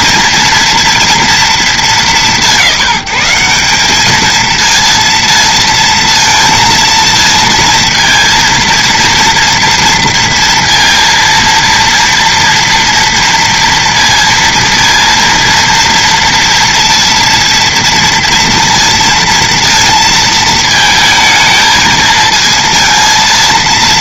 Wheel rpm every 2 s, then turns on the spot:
230, 190, 230, 230, 230, 230, 230, 230, 230, 230, 220, 230.
none